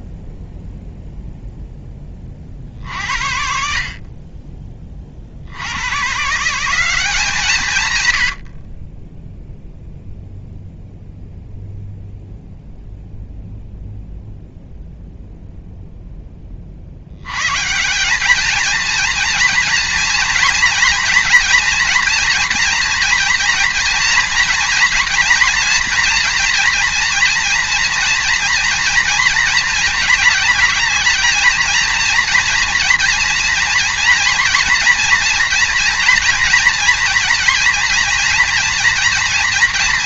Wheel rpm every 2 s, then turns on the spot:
0, 40, 30, 160, 50, 0, 0, 0, 20, 220, 230, 240, 230, 230, 230, 210, 230, 230, 230, 230.
none